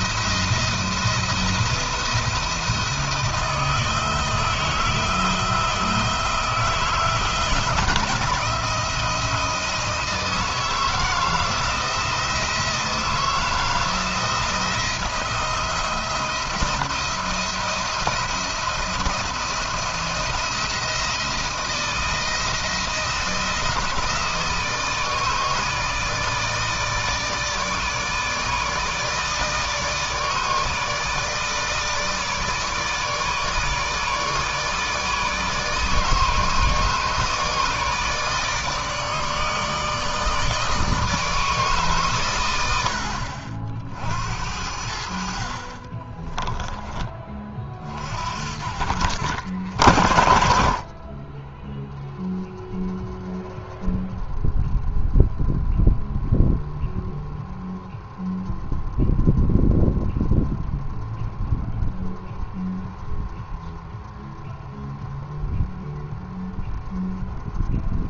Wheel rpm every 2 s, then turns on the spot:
170, 170, 160, 160, 170, 160, 170, 170, 160, 170, 170, 160, 160, 160, 150, 150, 160, 160, 150, 150, 150, 90, 70, 20, 50, 80, 0, 0, 0, 0, 0, 0, 0, 0.
none